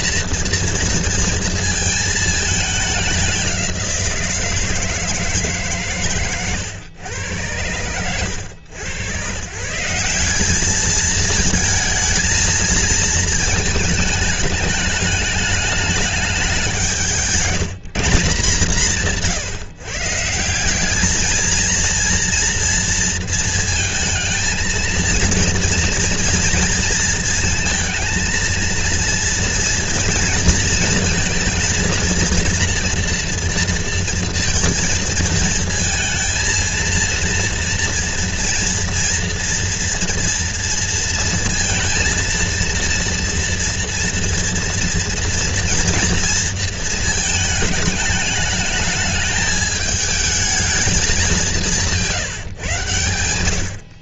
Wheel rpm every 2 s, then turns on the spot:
230, 200, 160, 110, 110, 210, 220, 210, 170, 160, 200, 230, 230, 230, 230, 230, 230, 230, 230, 240, 230, 230, 230, 230, 210, 220, 110.
none